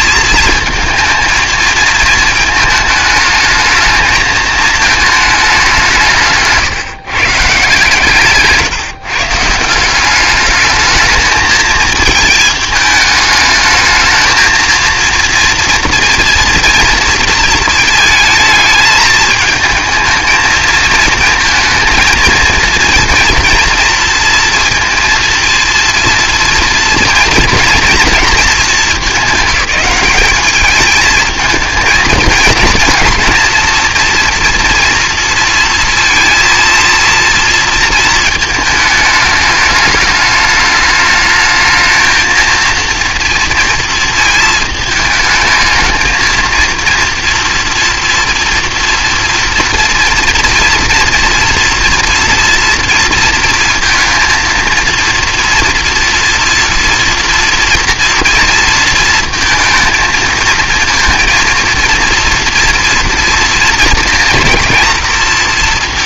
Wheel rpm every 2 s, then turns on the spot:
230, 220, 220, 150, 150, 210, 220, 230, 240, 220, 220, 230, 230, 230, 220, 210, 220, 230, 230, 220, 210, 230, 220, 230, 230, 230, 240, 230, 230, 230, 230, 230, 240.
none